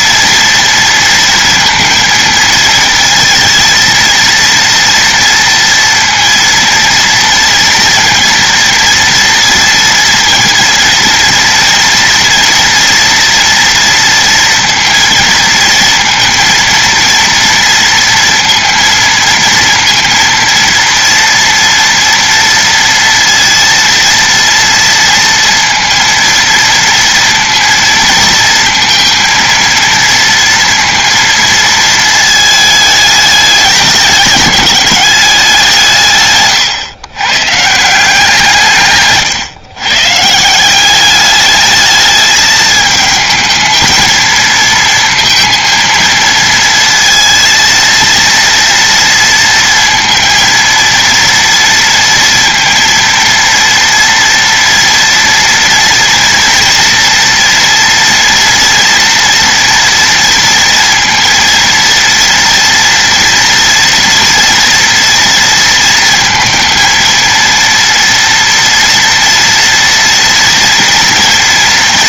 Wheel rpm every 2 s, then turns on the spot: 230, 230, 230, 230, 230, 230, 240, 230, 230, 230, 230, 230, 230, 230, 230, 230, 210, 200, 130, 140, 200, 220, 230, 230, 230, 230, 230, 230, 230, 230, 230, 230, 230, 230, 240, 230.
none